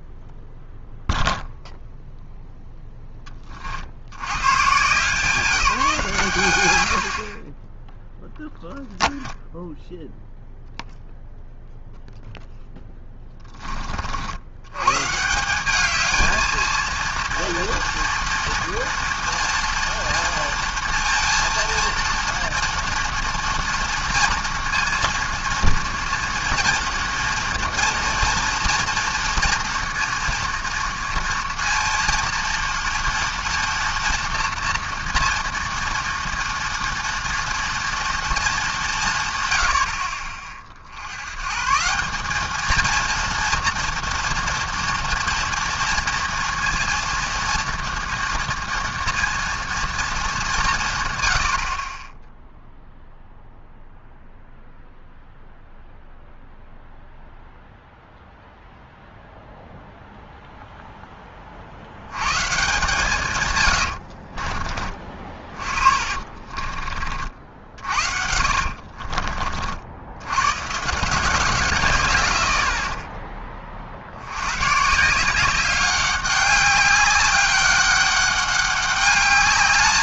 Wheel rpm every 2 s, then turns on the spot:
0, 0, 130, 110, 0, 0, 0, 100, 220, 230, 230, 230, 230, 230, 230, 230, 230, 240, 230, 210, 40, 220, 230, 230, 230, 190, 0, 0, 0, 0, 0, 140, 40, 40, 50, 130, 60, 120, 190, 200.
66-70